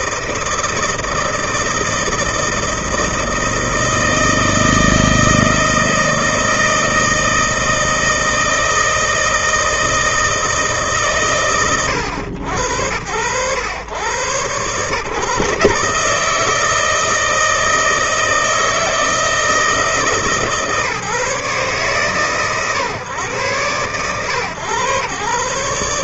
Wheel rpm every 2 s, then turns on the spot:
160, 160, 160, 160, 160, 130, 90, 120, 160, 160, 150, 130, 110.
none